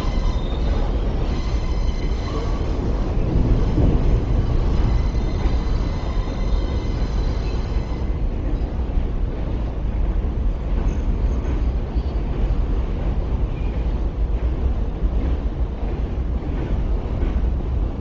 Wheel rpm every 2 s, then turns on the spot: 0, 0, 0, 0, 0, 0, 0, 0, 0.
none